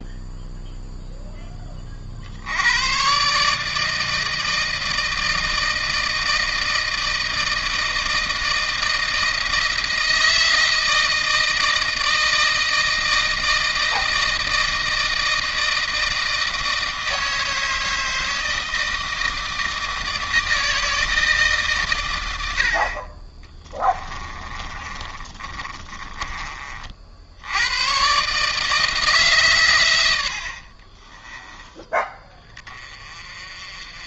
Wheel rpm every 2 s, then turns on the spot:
0, 90, 160, 160, 160, 160, 160, 160, 160, 160, 160, 60, 20, 40, 150, 40, 30.
24-26 30-32